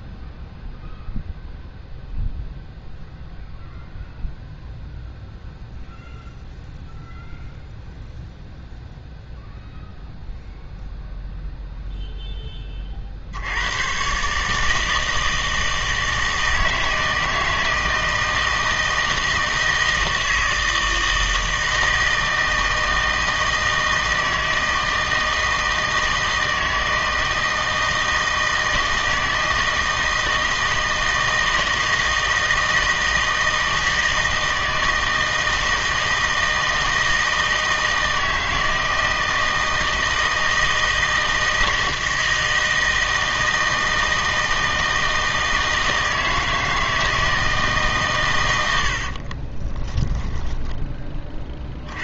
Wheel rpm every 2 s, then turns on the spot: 0, 0, 0, 0, 0, 0, 30, 160, 160, 160, 160, 160, 160, 160, 160, 160, 160, 160, 160, 160, 160, 160, 160, 160, 80, 10.
48-50